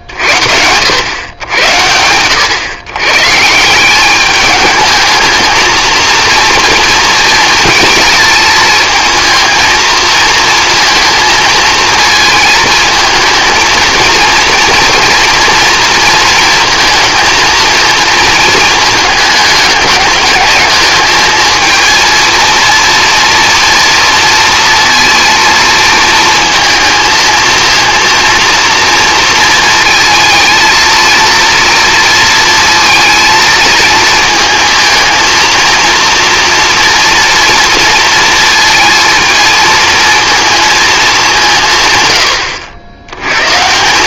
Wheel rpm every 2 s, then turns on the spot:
80, 100, 210, 230, 220, 220, 220, 230, 220, 220, 210, 230, 230, 220, 230, 220, 230, 230, 230, 230, 220, 80.
none